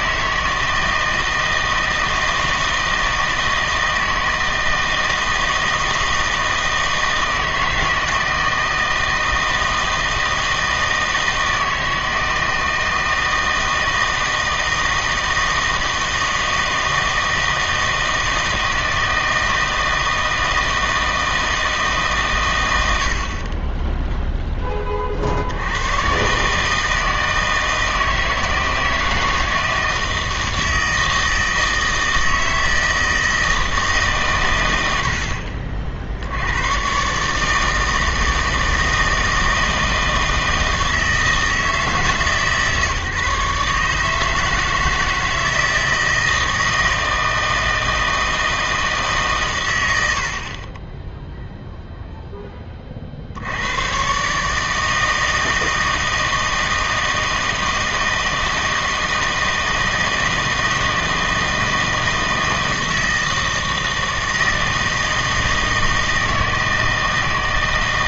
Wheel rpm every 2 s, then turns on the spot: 160, 160, 160, 160, 160, 160, 160, 160, 160, 160, 160, 70, 30, 160, 160, 160, 160, 80, 130, 160, 160, 150, 160, 160, 160, 20, 30, 160, 160, 160, 160, 160, 160, 160.
none